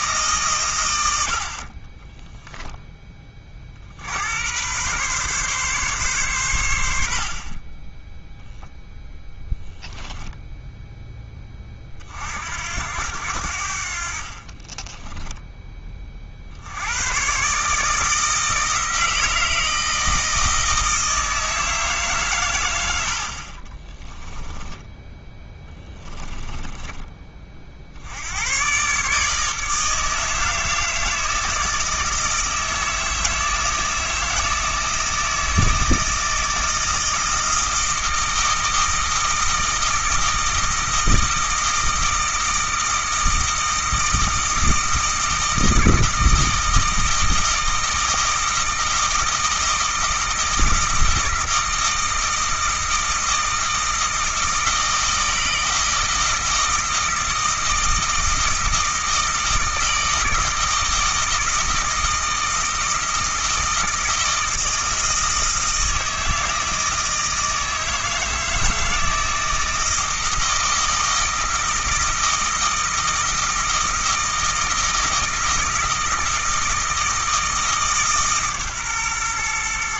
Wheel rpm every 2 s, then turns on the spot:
100, 20, 120, 80, 0, 10, 80, 20, 90, 160, 160, 90, 10, 20, 130, 160, 160, 160, 160, 160, 160, 160, 160, 160, 160, 160, 160, 160, 160, 160, 160, 160, 160, 160, 160, 160, 160, 160, 160, 130.
14-16 26-28